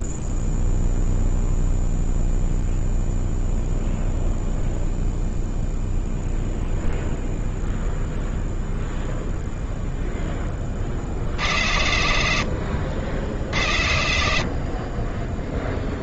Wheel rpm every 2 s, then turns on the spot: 0, 0, 0, 0, 0, 0, 60, 80.
none